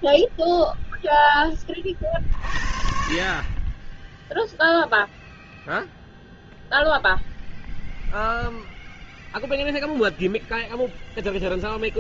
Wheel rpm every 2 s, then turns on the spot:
0, 50, 0, 0, 0, 0.
none